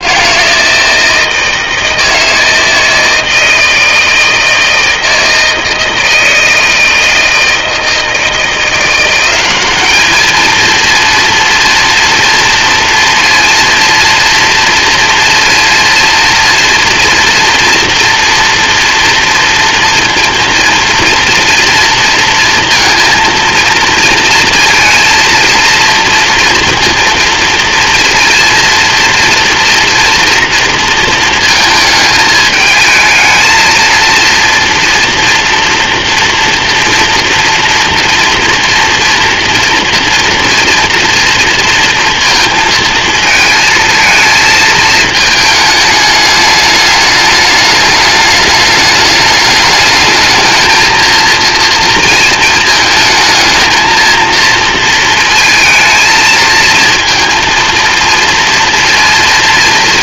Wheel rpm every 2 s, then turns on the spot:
160, 160, 160, 160, 190, 230, 230, 230, 240, 230, 230, 230, 230, 230, 230, 230, 220, 230, 230, 240, 230, 220, 210, 210, 210, 230, 220, 220, 230, 230.
none